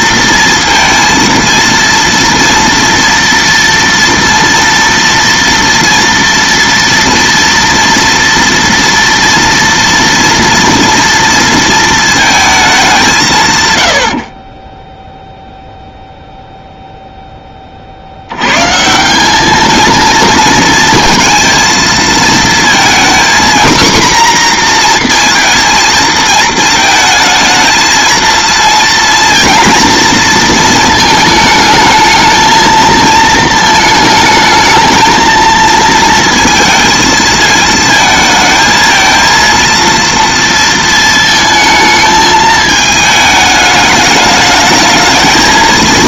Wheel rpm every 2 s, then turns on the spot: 230, 230, 230, 230, 230, 230, 220, 40, 0, 130, 230, 230, 250, 220, 230, 230, 220, 220, 220, 220, 230, 220, 210.
14-16